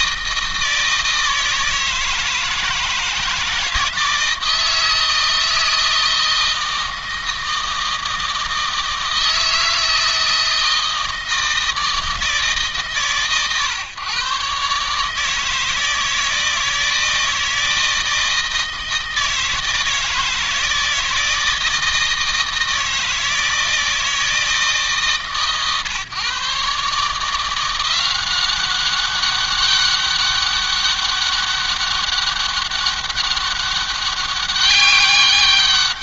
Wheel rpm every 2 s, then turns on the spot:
160, 160, 160, 160, 160, 160, 150, 140, 160, 160, 160, 160, 160, 140, 190, 200, 200, 200.
none